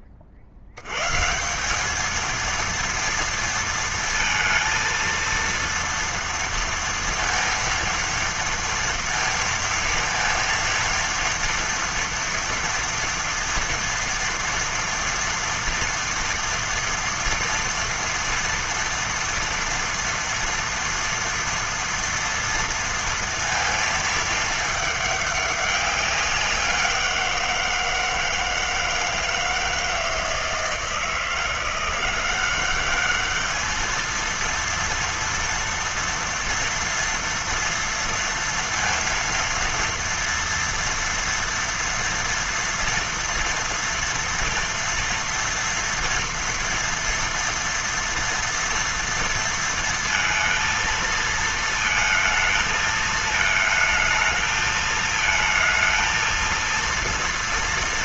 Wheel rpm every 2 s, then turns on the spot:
50, 230, 230, 230, 230, 230, 230, 230, 230, 230, 230, 230, 220, 190, 160, 160, 190, 230, 240, 230, 230, 230, 230, 230, 230, 230, 220, 220, 230.
none